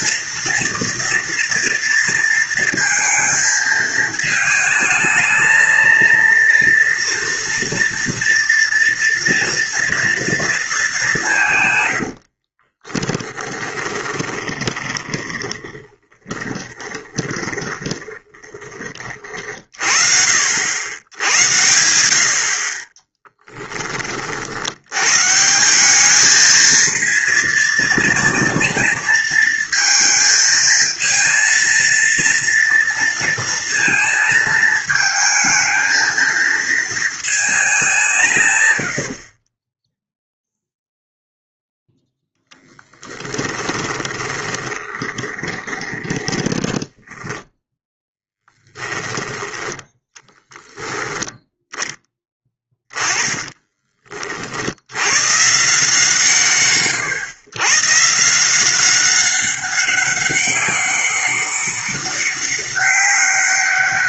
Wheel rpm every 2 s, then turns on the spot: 230, 230, 220, 230, 230, 190, 20, 10, 20, 30, 80, 30, 110, 220, 230, 230, 230, 220, 220, 80, 0, 10, 20, 30, 10, 10, 10, 90, 120, 190, 200, 180.
12-18 22-24 38-40 42-48 52-54